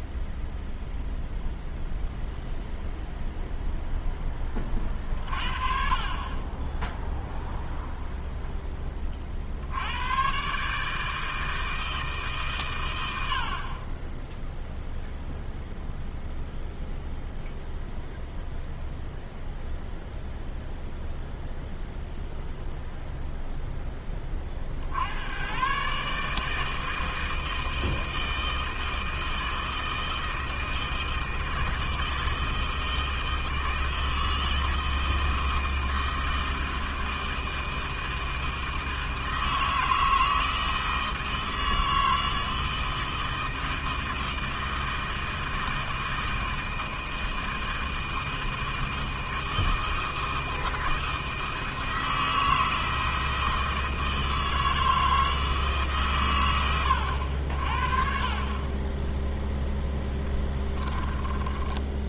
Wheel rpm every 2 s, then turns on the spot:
0, 0, 30, 0, 20, 150, 100, 0, 0, 0, 0, 0, 70, 160, 160, 160, 160, 160, 160, 160, 160, 160, 160, 160, 160, 160, 160, 160, 90, 20, 10.
60-62